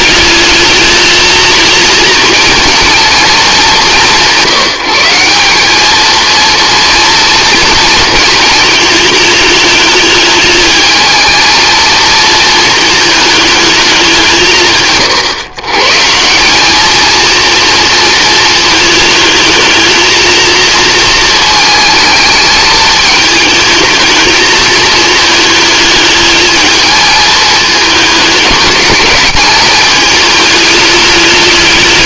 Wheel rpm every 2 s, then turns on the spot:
220, 220, 180, 230, 220, 220, 220, 100, 220, 220, 220, 220, 220, 220, 200, 210.
none